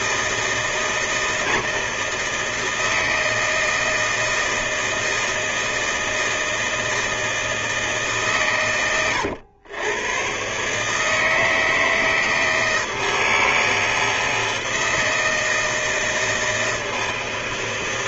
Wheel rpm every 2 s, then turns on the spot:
160, 160, 160, 160, 120, 140, 160, 160, 160.
none